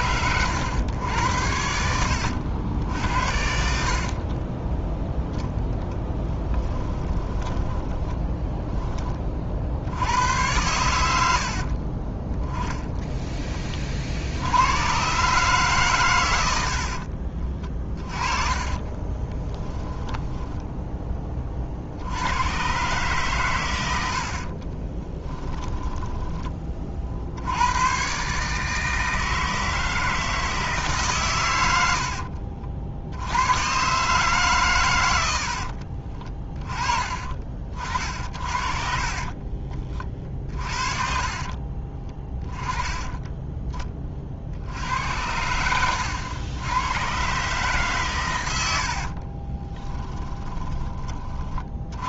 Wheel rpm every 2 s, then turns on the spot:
100, 70, 10, 20, 10, 110, 10, 100, 70, 20, 10, 120, 30, 30, 150, 150, 60, 130, 30, 50, 40, 30, 70, 100, 80, 20.
6-8 18-22 24-26 38-42